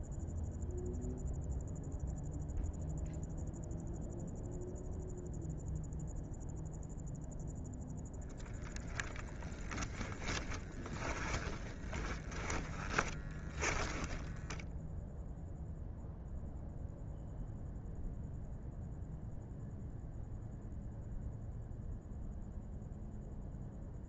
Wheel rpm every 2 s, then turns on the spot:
0, 0, 0, 0, 0, 10, 10, 0, 0, 0, 0, 0.
10-14